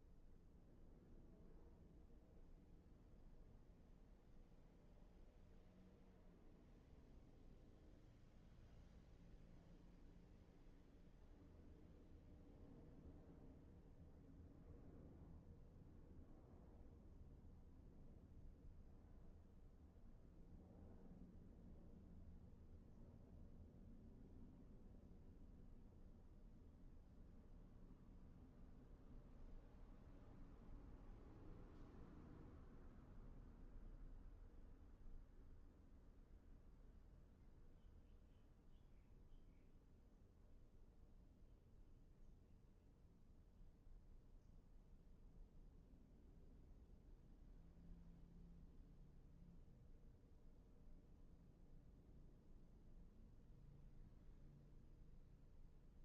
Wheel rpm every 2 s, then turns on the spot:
0, 0, 0, 0, 0, 0, 0, 0, 0, 0, 0, 0, 0, 0, 0, 0, 0, 0, 0, 0, 0, 0, 0, 0, 0, 0, 0, 0.
none